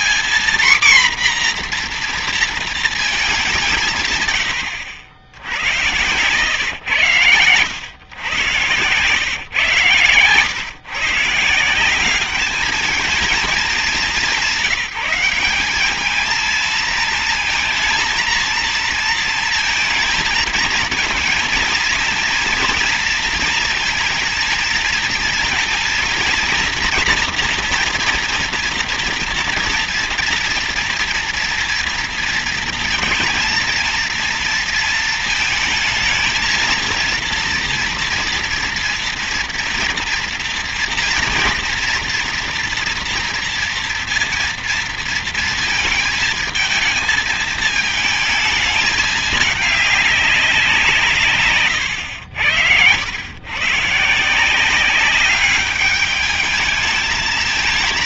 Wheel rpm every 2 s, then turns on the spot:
240, 230, 100, 120, 110, 140, 200, 190, 220, 220, 220, 230, 230, 230, 230, 230, 230, 230, 230, 230, 230, 230, 230, 220, 220, 190, 100, 170, 210.
none